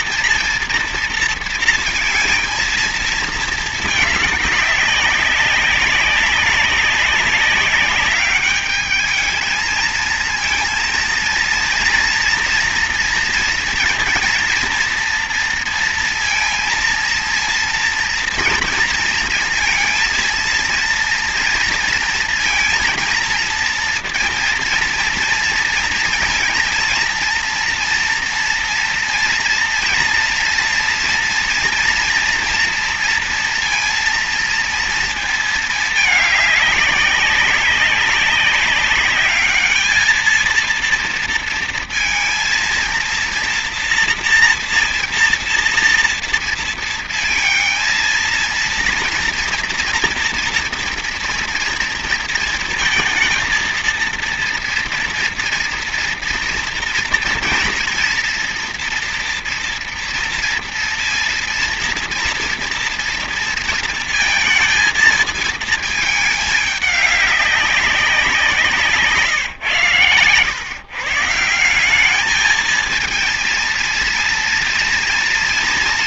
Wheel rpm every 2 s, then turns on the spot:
230, 230, 210, 200, 210, 230, 230, 230, 230, 230, 230, 230, 230, 230, 230, 240, 230, 230, 200, 190, 230, 230, 230, 230, 230, 230, 230, 240, 230, 230, 230, 230, 230, 210, 170, 130, 210, 230.
none